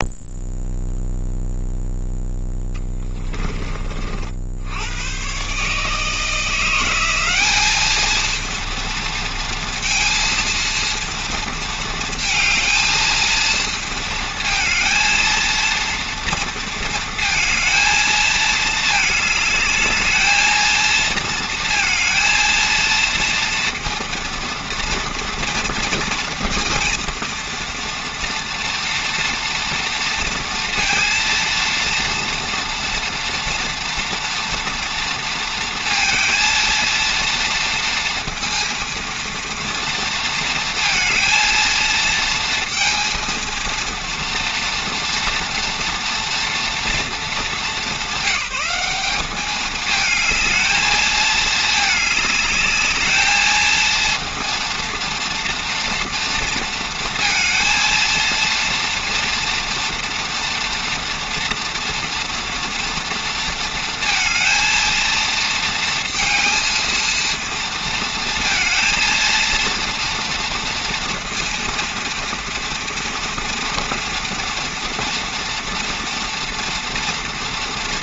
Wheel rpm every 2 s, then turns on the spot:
0, 10, 100, 180, 230, 230, 230, 230, 230, 220, 220, 230, 230, 230, 240, 230, 230, 230, 230, 230, 230, 230, 230, 230, 200, 220, 220, 230, 230, 240, 230, 230, 220, 230, 230, 230, 230, 230, 230.
2-4